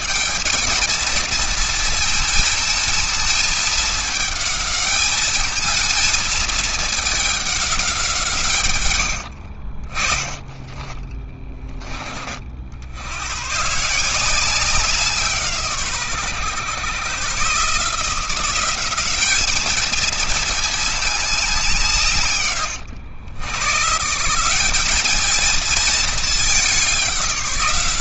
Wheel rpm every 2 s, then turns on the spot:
230, 220, 220, 210, 90, 20, 90, 170, 120, 200, 210, 110, 210, 190.
8-10